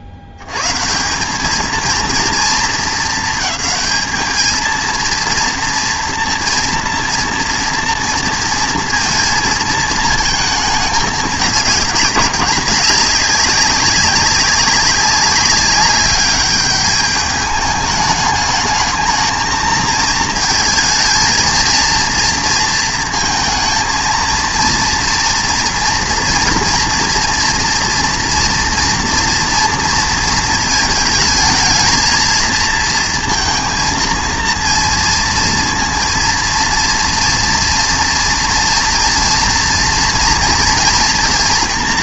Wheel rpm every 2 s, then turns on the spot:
100, 230, 220, 230, 230, 220, 200, 190, 200, 220, 220, 230, 230, 230, 230, 220, 230, 230, 230, 240, 230.
none